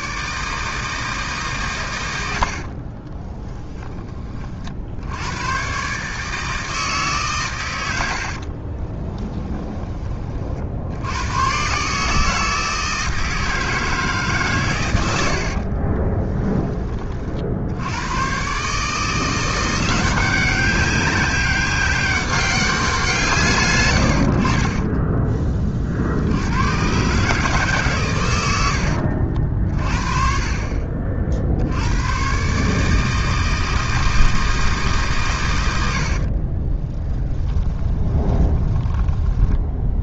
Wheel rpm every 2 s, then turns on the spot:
160, 60, 50, 160, 40, 60, 160, 120, 20, 140, 190, 190, 30, 100, 80, 40, 150, 160, 30, 20.
2-4 8-10 24-26 36-40